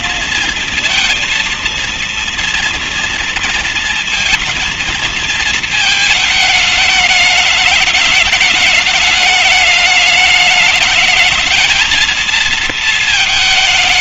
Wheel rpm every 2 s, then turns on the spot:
230, 240, 230, 220, 210, 210, 220.
none